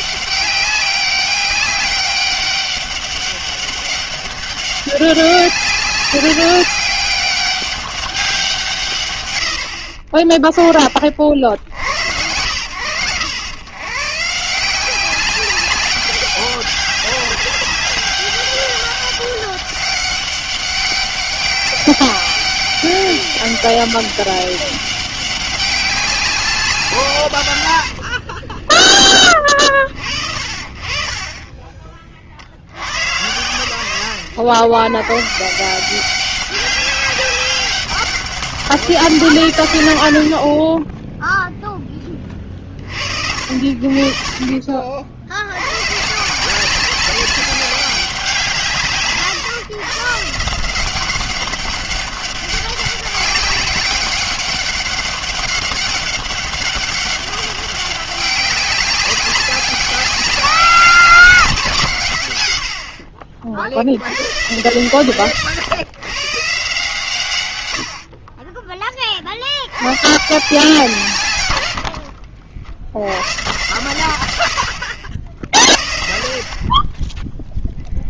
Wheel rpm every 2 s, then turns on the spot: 200, 200, 200, 200, 110, 50, 100, 190, 200, 200, 200, 200, 200, 130, 20, 40, 100, 100, 200, 180, 10, 40, 60, 190, 140, 190, 200, 200, 200, 200, 190, 50, 110, 140, 20, 150, 70, 70, 30.
none